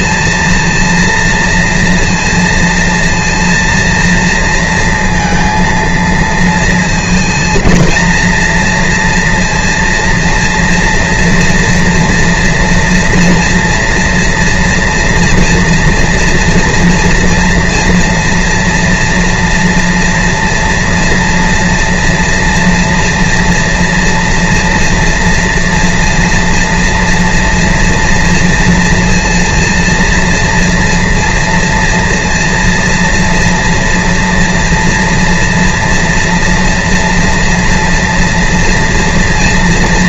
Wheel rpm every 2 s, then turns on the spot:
230, 230, 230, 230, 230, 230, 240, 230, 230, 230, 230, 230, 230, 230, 230, 230, 230, 240, 230, 230.
none